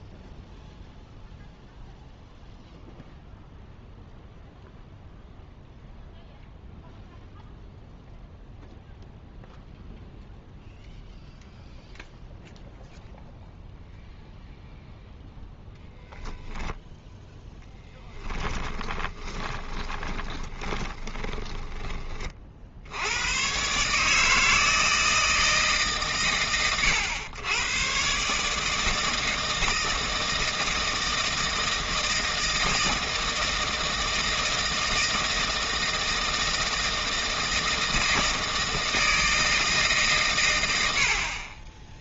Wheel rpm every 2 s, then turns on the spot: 0, 0, 0, 0, 0, 0, 0, 0, 0, 20, 20, 60, 160, 110, 160, 160, 160, 160, 160, 160, 80.
18-22